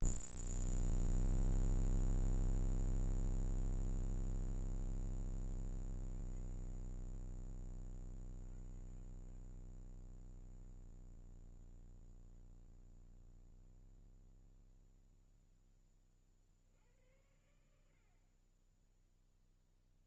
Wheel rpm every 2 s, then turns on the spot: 0, 0, 20, 30, 50, 20, 20, 0, 70, 10.
10-12